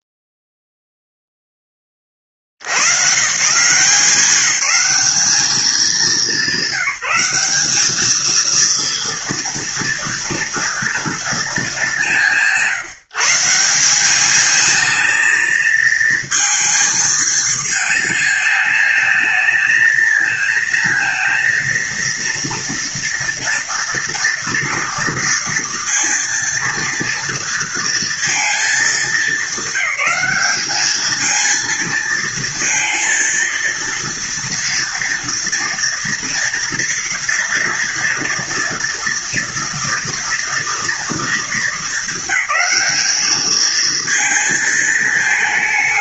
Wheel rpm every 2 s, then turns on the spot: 0, 50, 190, 180, 230, 230, 180, 210, 230, 220, 220, 230, 230, 230, 220, 200, 230, 230, 230, 230, 230, 200, 220.
none